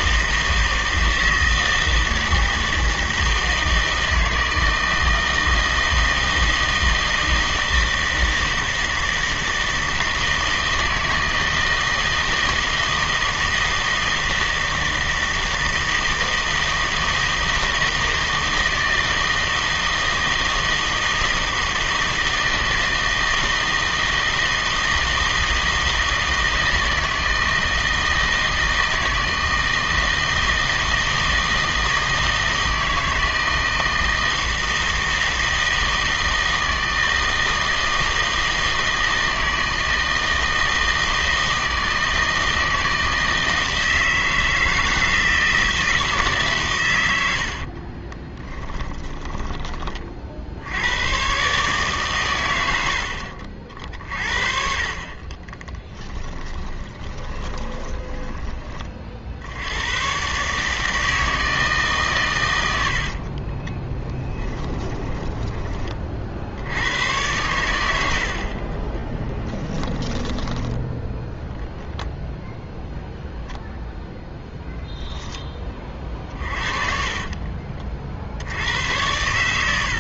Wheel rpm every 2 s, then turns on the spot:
160, 160, 160, 160, 160, 160, 160, 160, 160, 160, 160, 160, 160, 160, 160, 160, 160, 160, 160, 160, 160, 160, 160, 130, 20, 70, 90, 50, 20, 20, 150, 110, 30, 70, 40, 10, 0, 10, 30, 80.
48-50 56-58 64-66 68-70 76-78